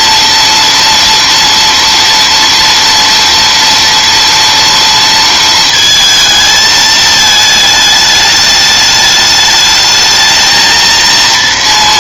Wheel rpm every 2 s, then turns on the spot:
230, 230, 230, 220, 210, 220.
none